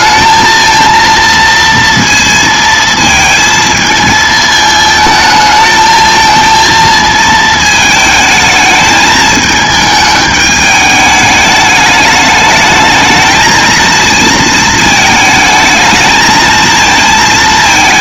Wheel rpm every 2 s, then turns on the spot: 230, 220, 220, 230, 220, 210, 220, 220, 230.
none